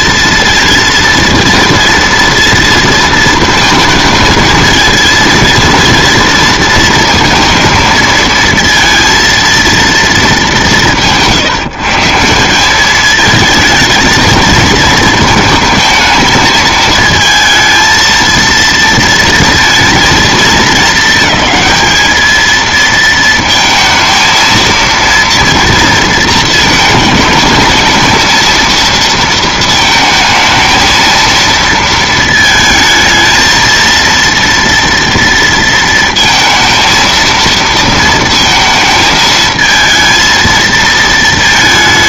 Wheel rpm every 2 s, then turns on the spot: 230, 230, 220, 230, 230, 200, 190, 230, 220, 230, 220, 220, 230, 220, 230, 220, 220, 230, 230, 230, 220.
none